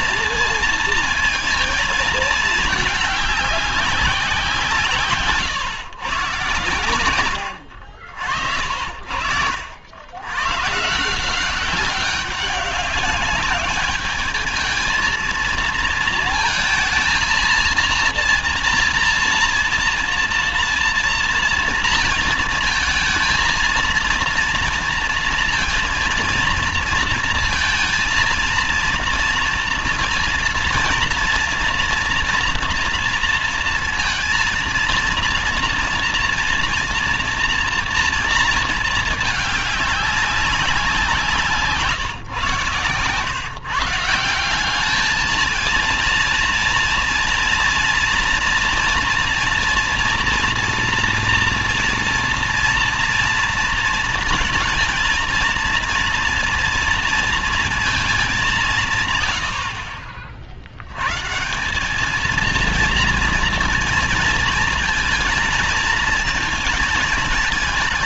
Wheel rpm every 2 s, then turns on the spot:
230, 220, 170, 140, 50, 120, 200, 210, 230, 230, 230, 230, 230, 230, 230, 230, 240, 230, 240, 230, 190, 130, 180, 230, 230, 230, 230, 220, 230, 190, 60, 220, 230, 220.
none